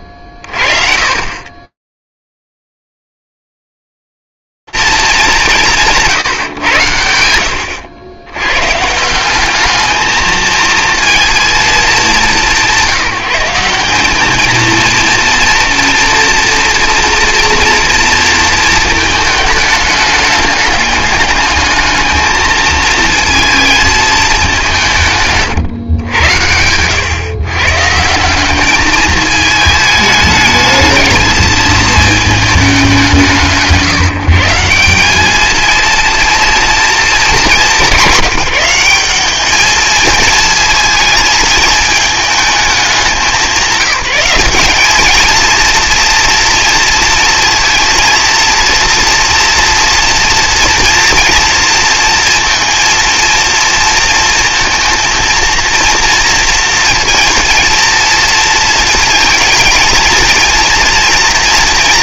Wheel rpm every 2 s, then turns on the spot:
30, 0, 180, 190, 90, 210, 220, 180, 230, 230, 210, 210, 220, 120, 140, 210, 220, 140, 230, 200, 210, 220, 180, 230, 230, 230, 230, 230, 230, 230, 230.
none